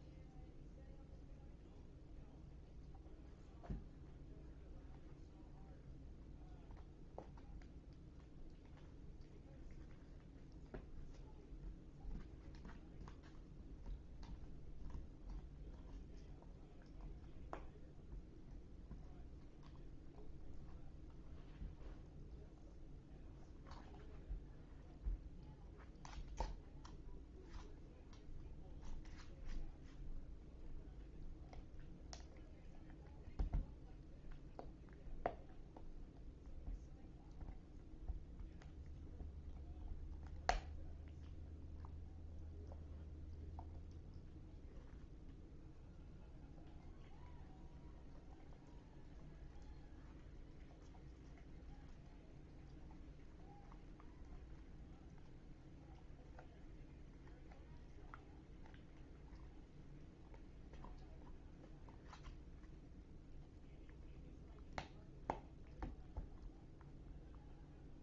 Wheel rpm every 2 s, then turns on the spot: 0, 0, 0, 0, 0, 0, 0, 0, 0, 0, 0, 0, 0, 0, 0, 0, 0, 0, 0, 0, 0, 0, 0, 0, 0, 0, 0, 0, 0, 0, 0, 0, 0, 0.
none